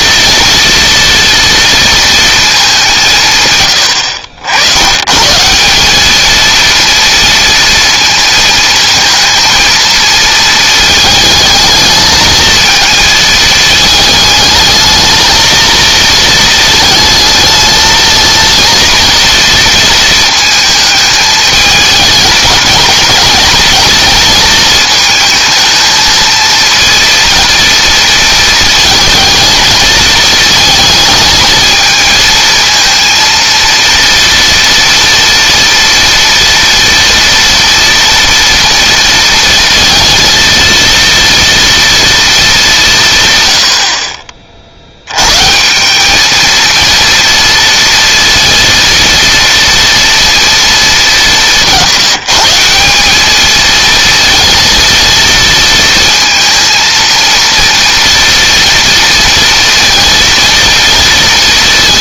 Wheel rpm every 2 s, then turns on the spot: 230, 200, 90, 230, 230, 220, 220, 220, 220, 230, 220, 210, 220, 230, 220, 220, 230, 230, 230, 230, 230, 190, 50, 220, 230, 210, 180, 230, 230, 230, 230.
none